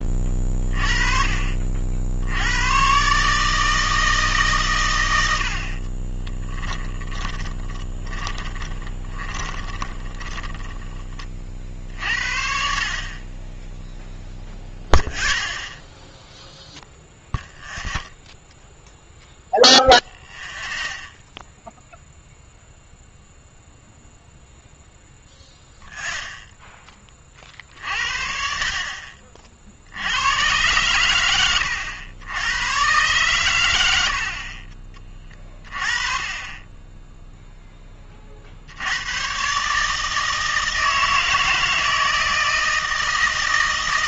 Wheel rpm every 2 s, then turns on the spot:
30, 110, 130, 20, 20, 10, 50, 0, 0, 0, 0, 0, 0, 10, 50, 110, 110, 30, 20, 80, 160, 160.
6-10